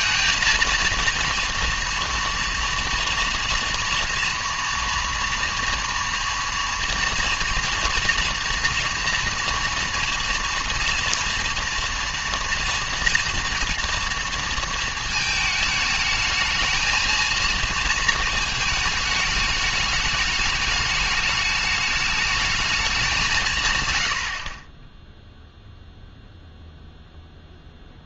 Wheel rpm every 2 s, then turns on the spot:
220, 230, 230, 230, 230, 230, 230, 230, 220, 220, 210, 210, 20, 0.
none